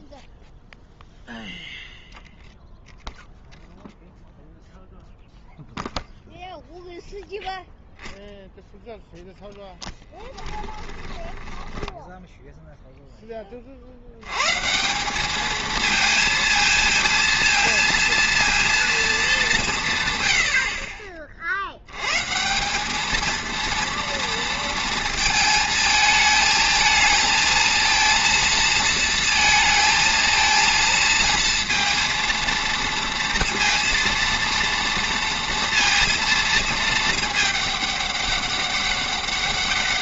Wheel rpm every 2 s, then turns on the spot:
0, 0, 0, 0, 0, 10, 0, 150, 230, 230, 60, 160, 230, 220, 230, 230, 230, 230, 230, 200.
10-12